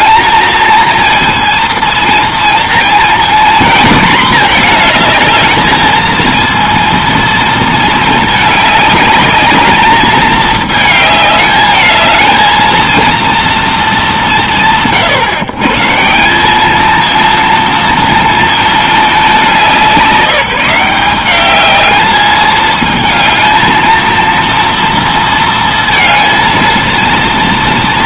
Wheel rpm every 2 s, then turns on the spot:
220, 230, 230, 230, 210, 210, 230, 130, 210, 220, 180, 220, 230, 230.
none